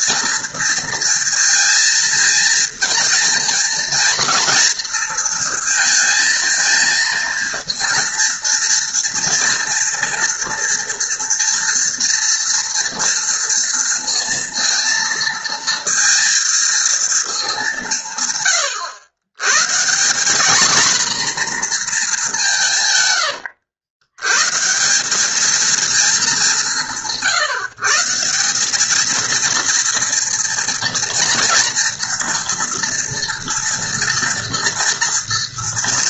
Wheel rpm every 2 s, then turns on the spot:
230, 230, 230, 230, 240, 240, 230, 230, 230, 120, 240, 130, 180, 170, 220, 230, 230, 230.
none